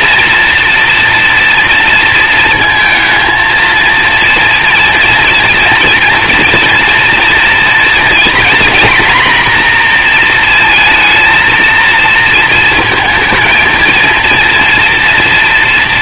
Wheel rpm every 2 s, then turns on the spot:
230, 220, 230, 230, 240, 230, 220, 230.
none